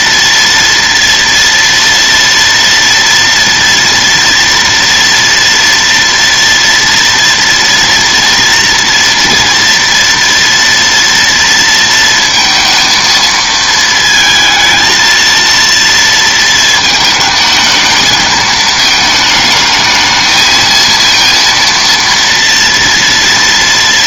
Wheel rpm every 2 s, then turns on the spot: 230, 230, 230, 230, 230, 230, 230, 220, 220, 220, 220, 230.
none